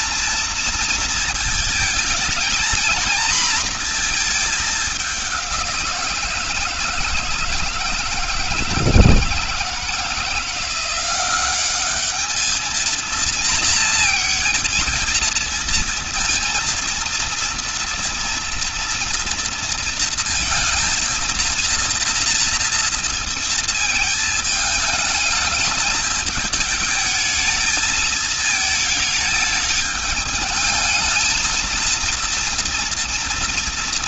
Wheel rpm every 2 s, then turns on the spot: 230, 220, 210, 160, 160, 180, 220, 230, 230, 230, 230, 230, 220, 210, 220, 220, 230.
none